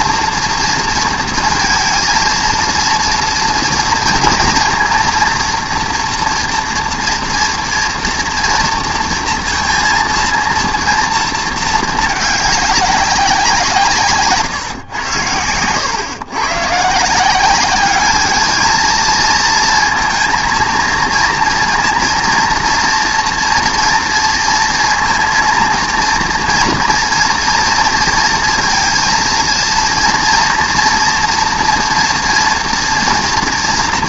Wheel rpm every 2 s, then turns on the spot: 230, 230, 230, 230, 230, 230, 200, 140, 130, 220, 230, 230, 230, 230, 230, 230, 230.
none